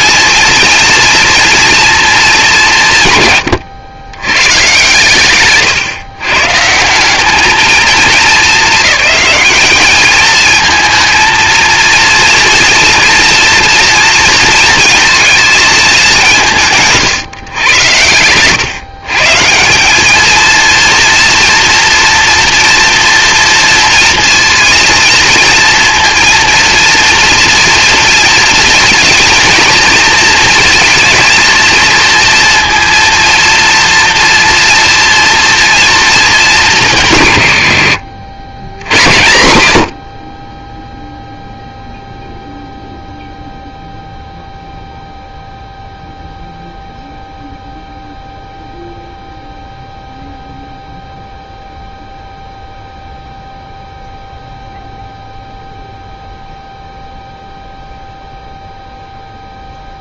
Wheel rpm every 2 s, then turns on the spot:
220, 200, 120, 150, 200, 220, 230, 230, 170, 130, 230, 230, 230, 230, 230, 230, 230, 230, 170, 110, 20, 0, 0, 0, 0, 0, 0, 0, 0, 0.
none